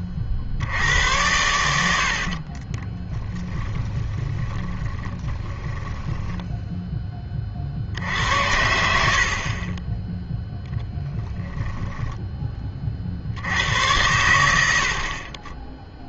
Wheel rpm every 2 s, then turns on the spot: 80, 30, 20, 0, 80, 10, 30, 70.
2-6 10-12